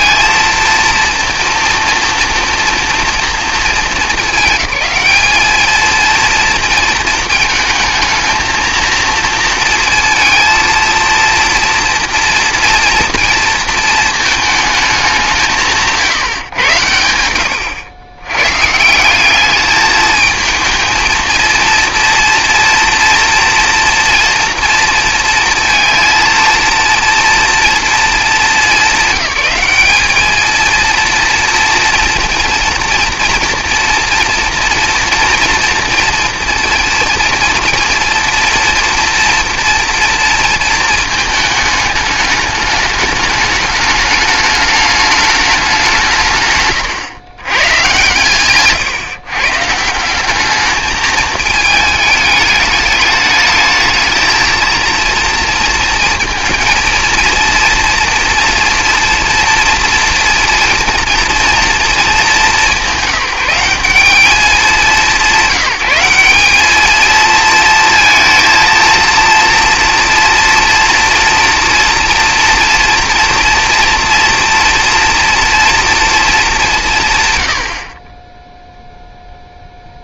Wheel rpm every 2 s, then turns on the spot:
230, 230, 210, 230, 230, 230, 230, 210, 100, 170, 230, 230, 230, 230, 190, 220, 230, 240, 230, 230, 220, 210, 210, 130, 140, 210, 210, 230, 230, 230, 230, 190, 180, 210, 230, 240, 240, 230, 180, 0.
46-48